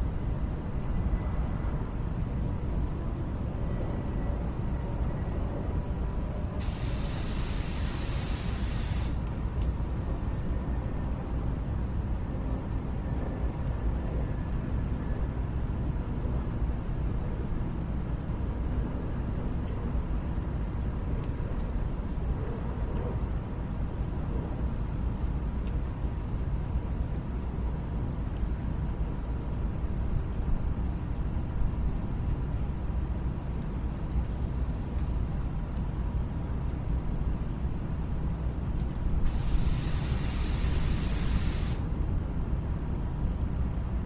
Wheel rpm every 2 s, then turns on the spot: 0, 0, 0, 0, 0, 0, 0, 0, 0, 0, 0, 0, 0, 0, 0, 0, 0, 0, 0, 0, 0, 0.
none